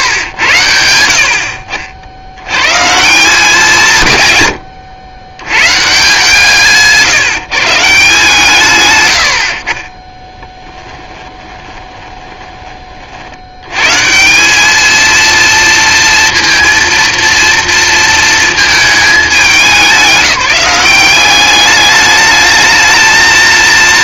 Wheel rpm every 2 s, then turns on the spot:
90, 90, 130, 160, 150, 20, 30, 200, 230, 220, 190, 220.
10-12